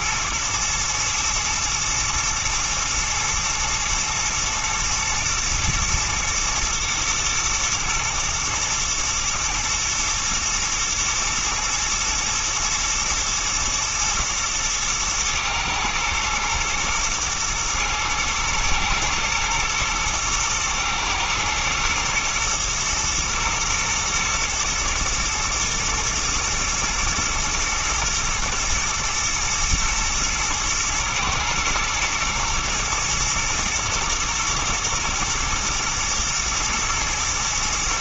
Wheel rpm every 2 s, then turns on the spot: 110, 120, 110, 110, 120, 120, 120, 110, 120, 110, 110, 120, 110, 110, 110, 110, 110, 110, 110.
none